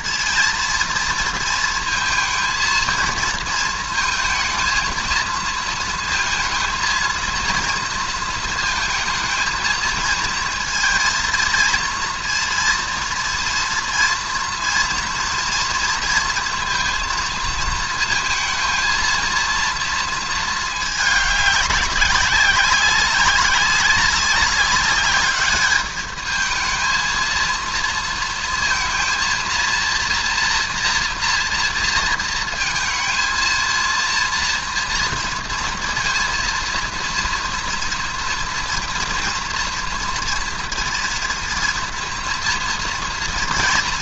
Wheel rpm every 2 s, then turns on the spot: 230, 230, 230, 230, 220, 230, 230, 230, 230, 230, 220, 190, 200, 220, 230, 230, 220, 230, 230, 230, 230, 230.
none